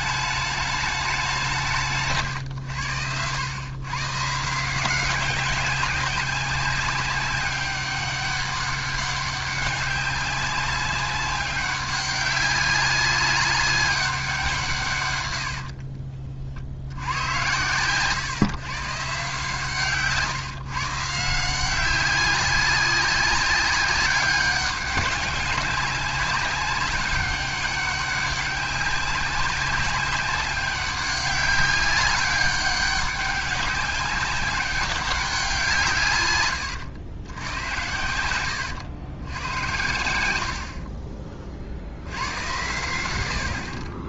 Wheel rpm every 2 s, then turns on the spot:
210, 110, 170, 190, 200, 200, 200, 160, 60, 140, 150, 190, 200, 200, 200, 190, 200, 200, 110, 100, 60, 100.
none